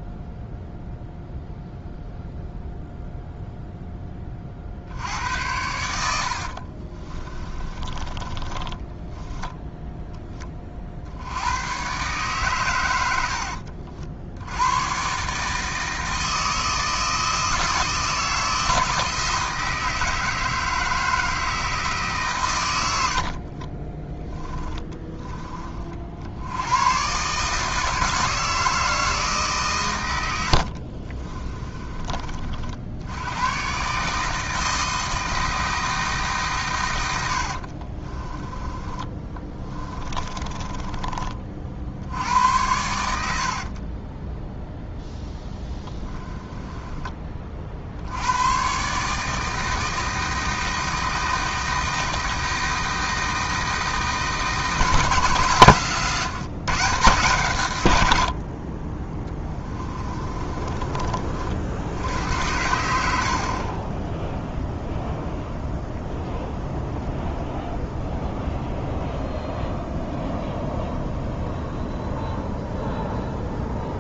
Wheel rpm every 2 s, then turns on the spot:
0, 0, 60, 30, 20, 50, 110, 120, 160, 160, 160, 100, 10, 110, 160, 60, 80, 160, 120, 20, 20, 90, 0, 20, 140, 160, 160, 170, 150, 30, 30, 80, 0, 0, 0, 0, 0.
6-10 24-26 30-32 38-42 60-62